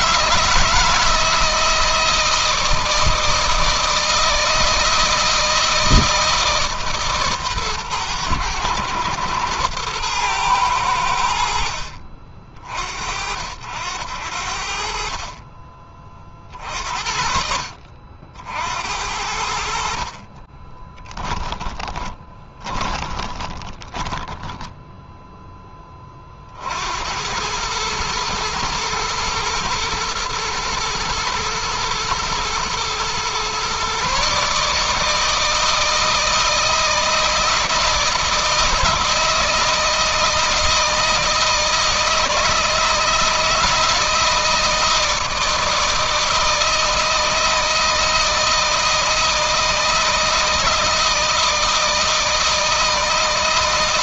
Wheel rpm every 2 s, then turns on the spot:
160, 160, 160, 160, 110, 110, 50, 70, 50, 70, 30, 20, 10, 40, 110, 120, 120, 150, 160, 160, 160, 160, 160, 160, 160, 160, 160.
20-26